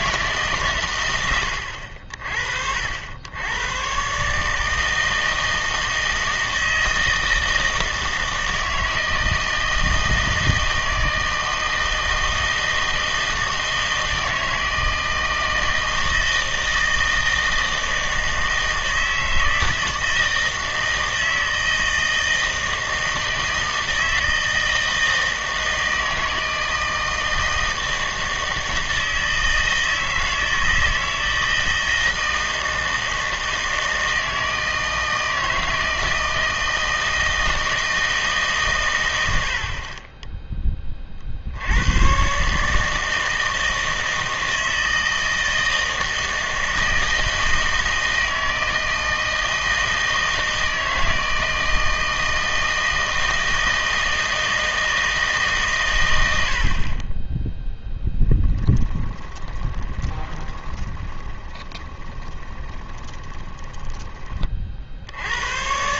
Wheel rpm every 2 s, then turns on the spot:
140, 60, 160, 160, 160, 160, 160, 160, 160, 160, 160, 160, 160, 160, 160, 160, 160, 160, 160, 130, 20, 150, 160, 160, 160, 160, 160, 160, 60, 10, 20, 20, 40.
58-64